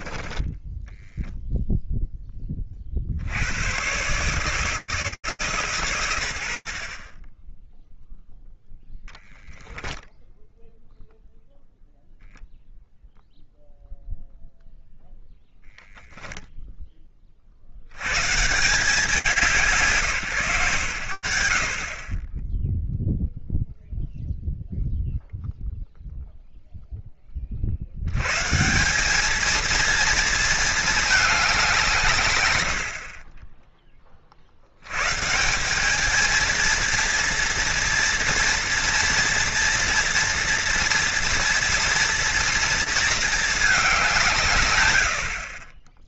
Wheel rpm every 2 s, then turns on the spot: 10, 70, 160, 60, 0, 0, 0, 0, 30, 150, 80, 0, 0, 20, 200, 210, 40, 180, 230, 230, 230, 220, 50.
0-2